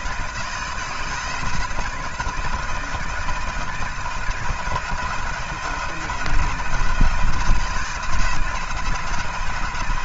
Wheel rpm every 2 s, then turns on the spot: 160, 160, 160, 170, 170.
none